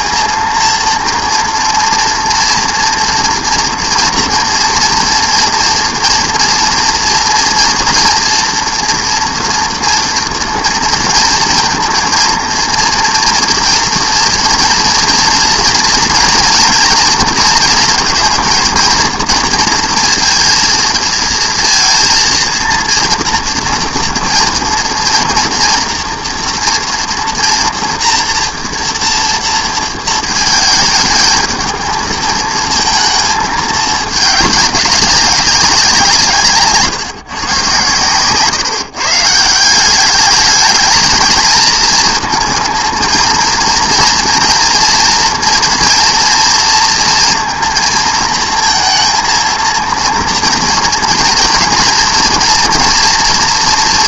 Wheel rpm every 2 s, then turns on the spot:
230, 230, 230, 230, 230, 230, 230, 230, 230, 230, 230, 230, 230, 230, 230, 220, 230, 200, 140, 140, 210, 230, 230, 230, 230, 240, 230.
none